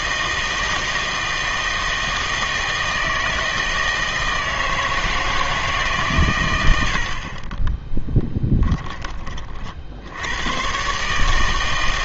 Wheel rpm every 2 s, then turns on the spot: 160, 160, 160, 100, 20, 110.
8-10